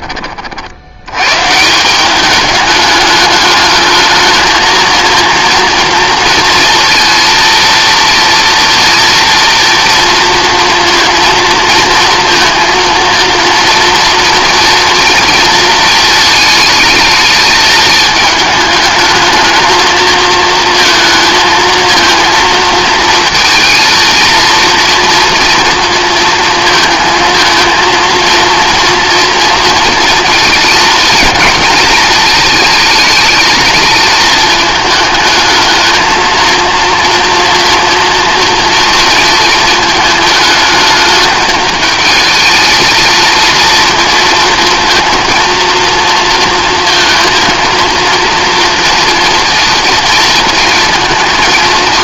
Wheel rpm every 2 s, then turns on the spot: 50, 210, 220, 230, 230, 230, 230, 230, 220, 210, 230, 220, 230, 230, 230, 230, 220, 220, 220, 230, 220, 220, 230, 230, 230, 230.
none